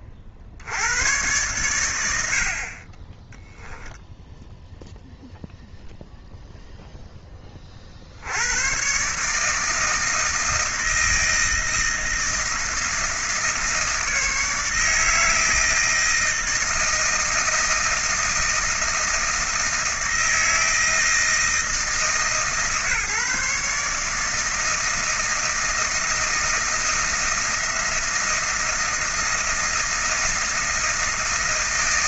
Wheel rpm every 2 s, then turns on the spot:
60, 50, 0, 0, 100, 160, 160, 160, 160, 160, 160, 140, 160, 160, 160, 160.
none